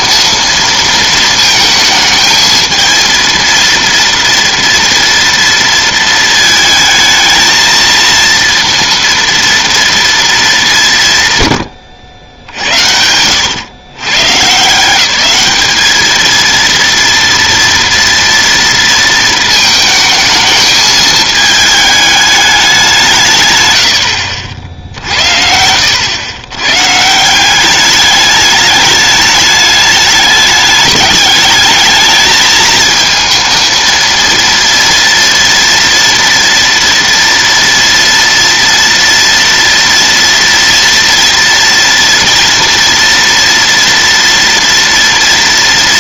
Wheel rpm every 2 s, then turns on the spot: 230, 220, 230, 220, 230, 200, 80, 140, 230, 230, 220, 200, 70, 120, 210, 210, 220, 230, 240, 230, 230, 230, 230.
none